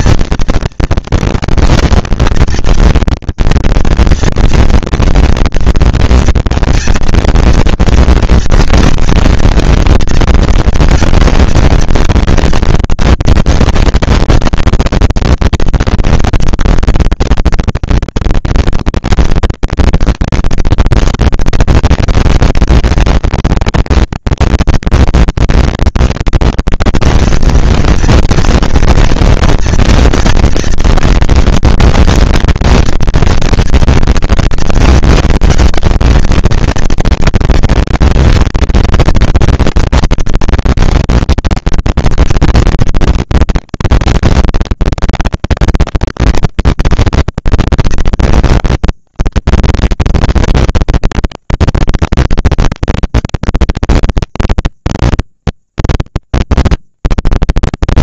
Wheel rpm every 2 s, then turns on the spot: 230, 230, 230, 230, 230, 230, 210, 200, 200, 230, 230, 230, 220, 240, 230, 230, 230, 220, 220, 230, 230, 230, 210, 190, 210, 230, 230, 230, 230.
none